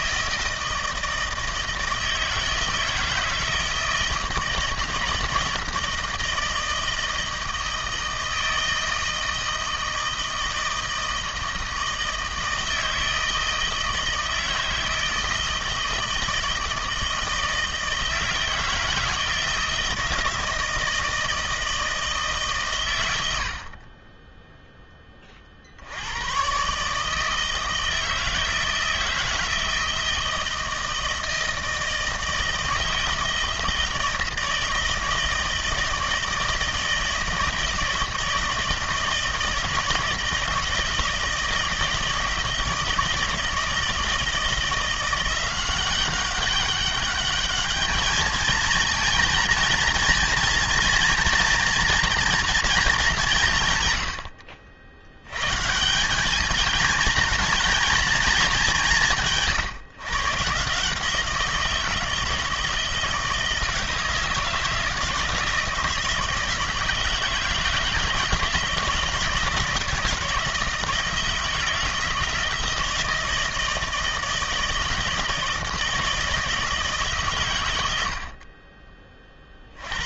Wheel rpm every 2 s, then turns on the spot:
160, 160, 160, 160, 160, 160, 160, 160, 160, 160, 160, 130, 10, 140, 160, 160, 160, 160, 160, 160, 160, 160, 170, 200, 220, 230, 210, 60, 220, 200, 150, 160, 160, 170, 160, 160, 160, 160, 160, 30.
none